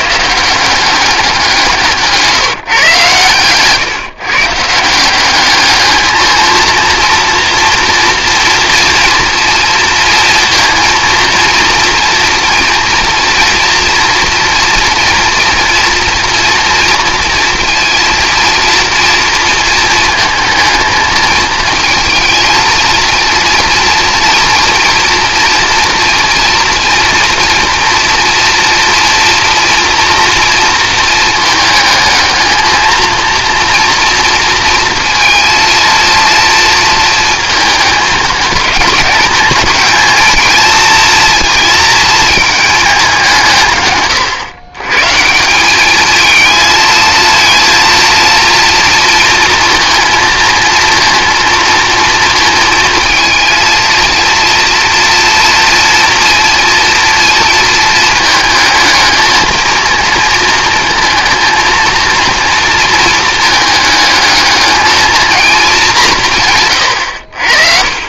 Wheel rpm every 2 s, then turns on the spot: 180, 140, 160, 230, 230, 230, 230, 230, 230, 230, 220, 230, 230, 230, 240, 230, 220, 230, 230, 210, 230, 210, 120, 220, 230, 230, 230, 230, 230, 220, 220, 230, 220, 130.
none